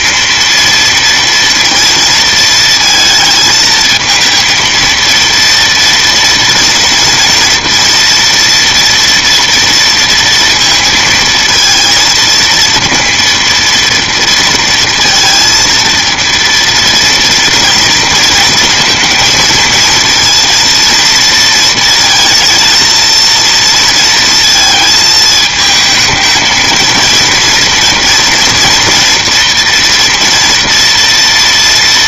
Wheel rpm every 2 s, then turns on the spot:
230, 220, 230, 230, 230, 230, 230, 230, 230, 230, 230, 230, 220, 230, 230, 230.
none